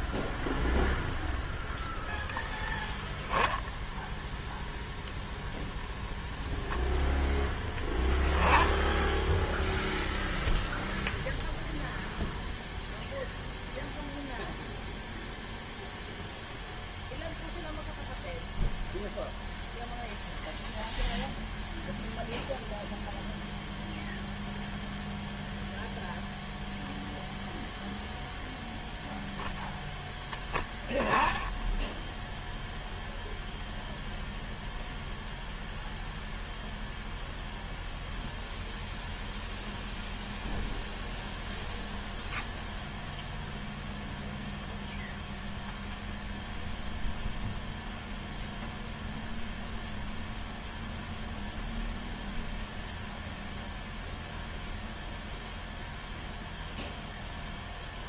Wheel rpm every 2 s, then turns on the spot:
0, 0, 0, 0, 10, 0, 0, 0, 0, 0, 0, 0, 0, 0, 0, 10, 0, 0, 0, 0, 0, 0, 0, 0, 0, 0, 0, 0, 0.
none